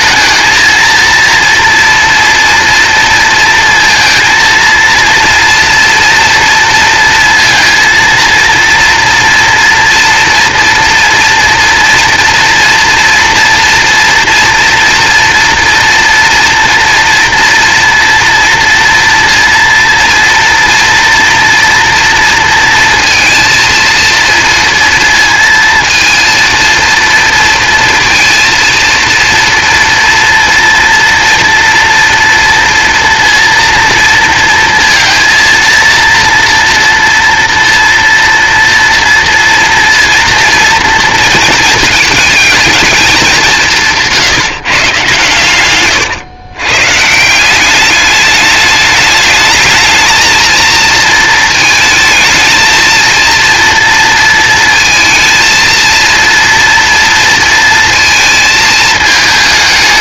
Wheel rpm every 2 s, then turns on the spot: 230, 230, 230, 230, 230, 240, 230, 230, 230, 230, 230, 230, 230, 230, 230, 230, 230, 230, 230, 240, 230, 220, 140, 130, 210, 220, 230, 220, 230, 220.
none